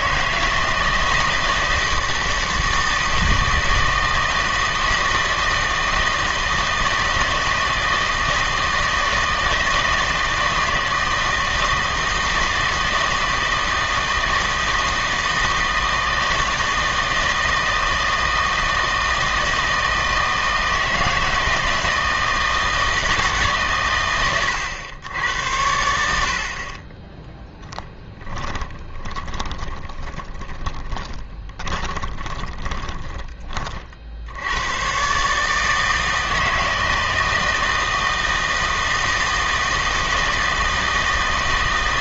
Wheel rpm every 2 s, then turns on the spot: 160, 160, 160, 160, 160, 160, 160, 160, 160, 160, 160, 160, 100, 40, 20, 20, 20, 100, 160, 160, 160.
28-34